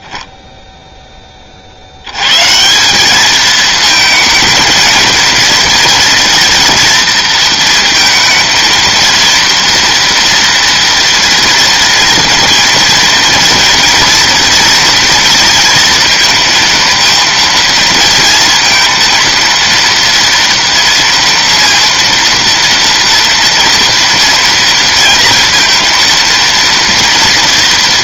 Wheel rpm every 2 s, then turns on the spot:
20, 150, 220, 230, 230, 230, 230, 230, 230, 230, 230, 230, 230, 230.
none